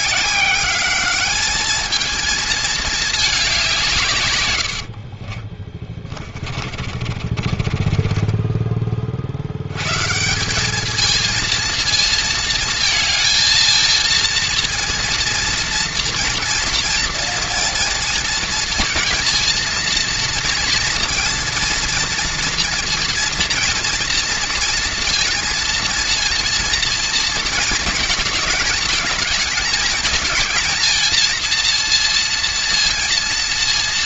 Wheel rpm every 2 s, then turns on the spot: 200, 220, 100, 50, 20, 200, 220, 230, 230, 230, 230, 230, 230, 230, 210, 220, 230.
4-10